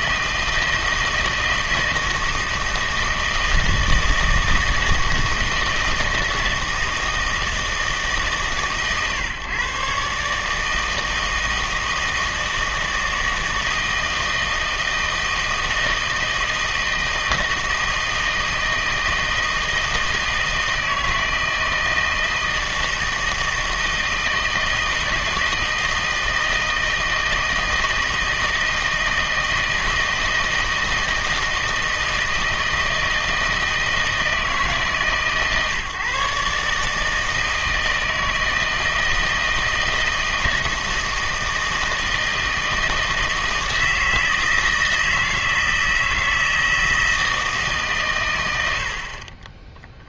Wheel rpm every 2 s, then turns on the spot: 160, 160, 160, 160, 140, 160, 160, 160, 160, 160, 160, 160, 160, 160, 160, 160, 160, 150, 150, 160, 160, 160, 160, 160, 80.
none